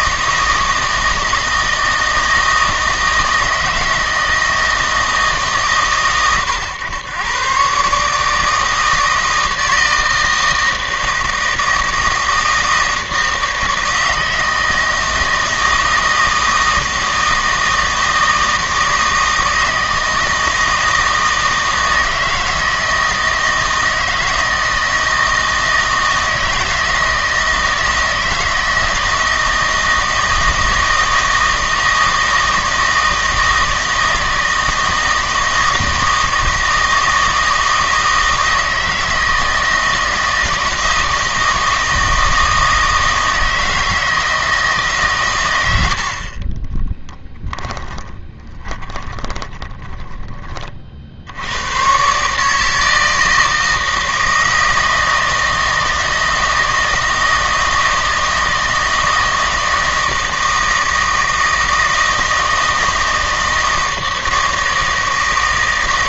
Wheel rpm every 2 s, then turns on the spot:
160, 160, 160, 110, 160, 160, 160, 160, 160, 160, 160, 160, 160, 160, 160, 160, 160, 160, 160, 160, 160, 160, 150, 20, 10, 30, 160, 160, 160, 160, 160, 160, 160.
46-50